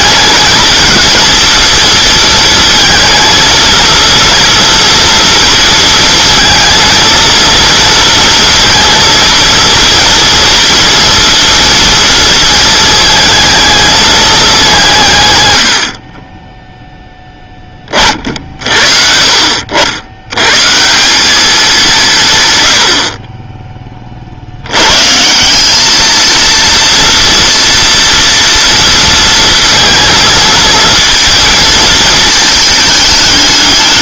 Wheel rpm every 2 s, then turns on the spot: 220, 230, 240, 230, 230, 230, 220, 180, 10, 50, 140, 100, 90, 230, 230, 230, 220.
none